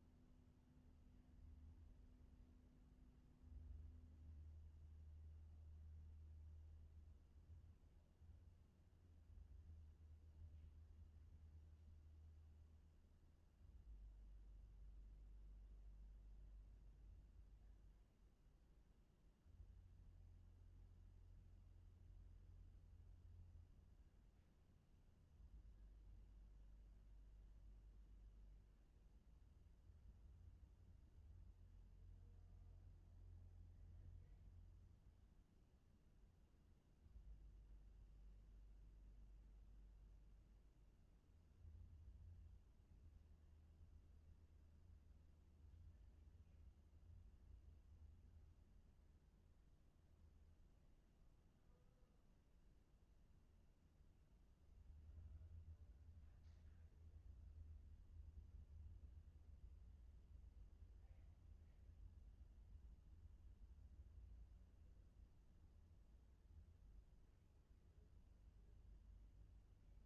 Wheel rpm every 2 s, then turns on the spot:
0, 0, 0, 0, 0, 0, 0, 0, 0, 0, 0, 0, 0, 0, 0, 0, 0, 0, 0, 0, 0, 0, 0, 0, 0, 0, 0, 0, 0, 0, 0, 0, 0, 0, 0.
none